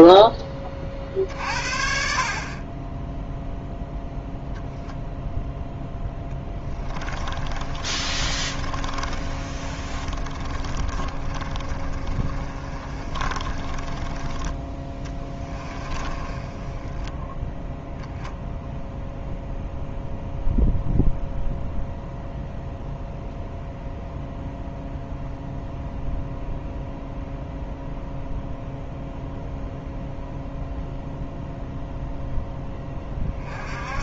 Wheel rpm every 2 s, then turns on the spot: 20, 30, 0, 20, 30, 30, 30, 20, 20, 0, 0, 0, 0, 0, 0, 0, 10.
6-14 16-18